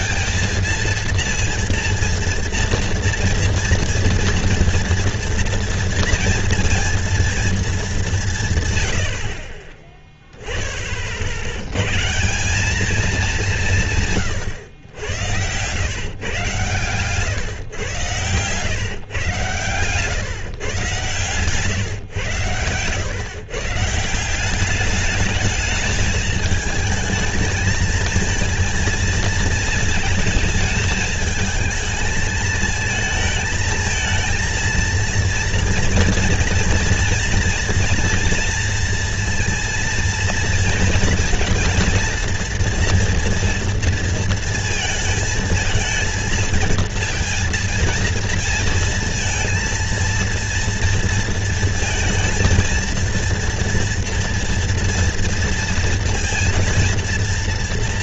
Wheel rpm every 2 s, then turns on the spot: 230, 230, 240, 230, 130, 20, 200, 110, 120, 130, 130, 110, 200, 220, 230, 220, 220, 230, 230, 230, 230, 230, 230, 220, 230, 230, 230, 230, 230.
22-24